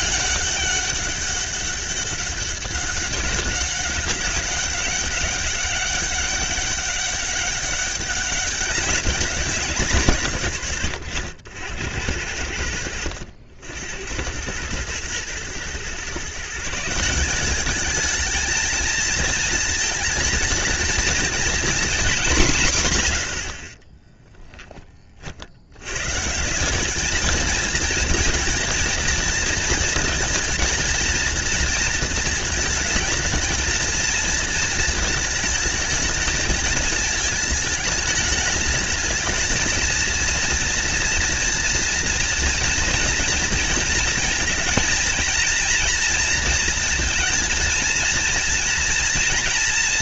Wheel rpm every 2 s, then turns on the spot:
200, 200, 200, 200, 190, 100, 70, 110, 170, 220, 230, 110, 40, 210, 230, 230, 220, 220, 220, 220, 240, 230, 230, 230, 230.
none